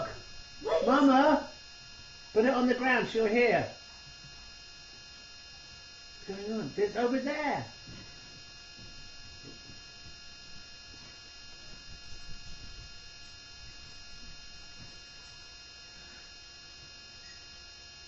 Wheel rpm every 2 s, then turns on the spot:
0, 0, 0, 0, 0, 0, 0, 0, 0.
none